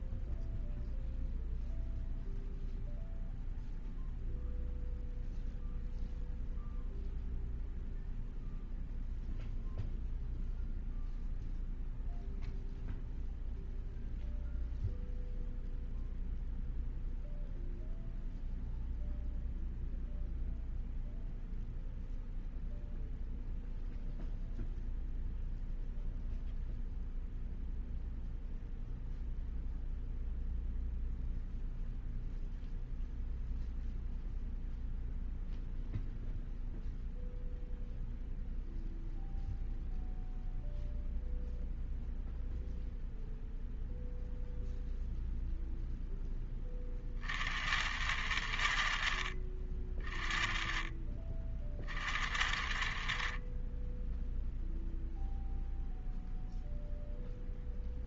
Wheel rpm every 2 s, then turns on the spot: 0, 0, 0, 0, 0, 0, 0, 0, 0, 0, 0, 0, 0, 0, 0, 0, 0, 0, 0, 0, 0, 0, 0, 20, 60, 30, 60, 0, 0.
none